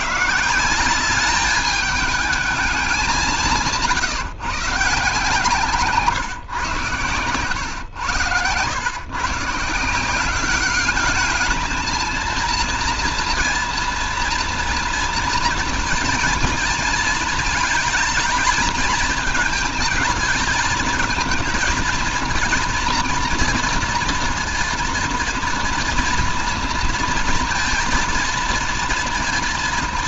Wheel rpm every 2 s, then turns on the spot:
170, 200, 140, 120, 100, 200, 230, 230, 230, 220, 220, 230, 230, 230, 230.
none